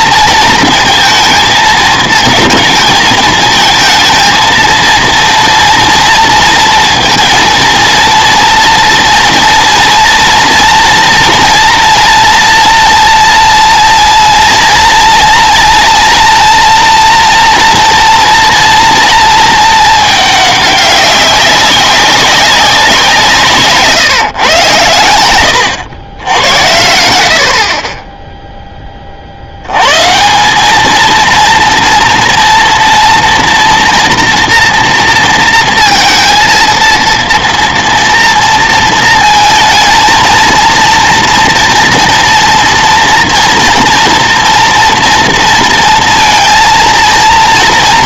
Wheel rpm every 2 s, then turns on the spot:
230, 220, 220, 230, 230, 230, 240, 230, 230, 230, 200, 190, 110, 80, 10, 200, 230, 230, 230, 230, 230, 230, 230, 230.
none